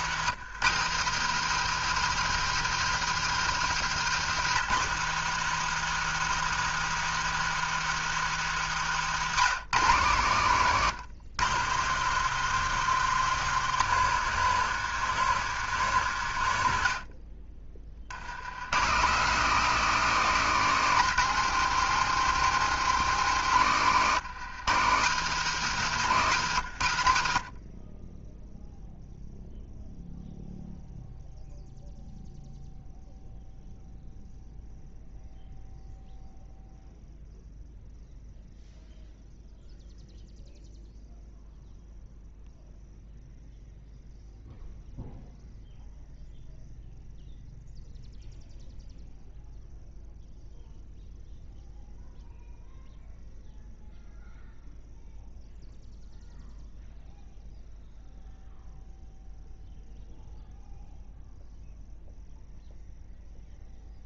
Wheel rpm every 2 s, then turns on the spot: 160, 190, 180, 190, 160, 140, 180, 160, 90, 110, 180, 190, 150, 130, 0, 0, 0, 0, 0, 0, 0, 0, 0, 0, 0, 0, 0, 0, 0, 0, 0, 0.
10-12